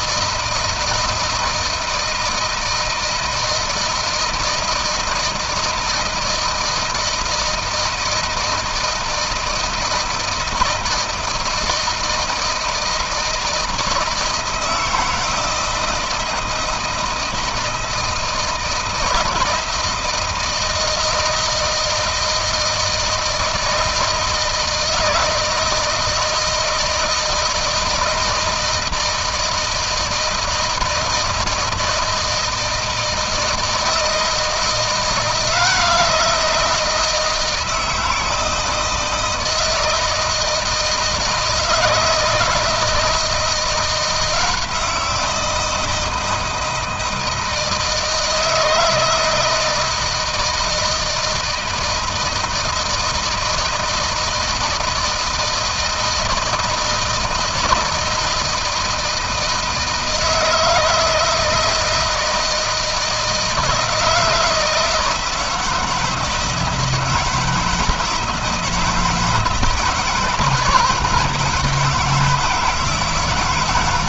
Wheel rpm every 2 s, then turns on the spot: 160, 160, 160, 160, 160, 160, 160, 160, 170, 160, 160, 160, 160, 160, 160, 160, 160, 160, 170, 160, 160, 160, 170, 160, 160, 160, 160, 160, 160, 160, 160, 160, 160, 160, 160, 170, 160.
none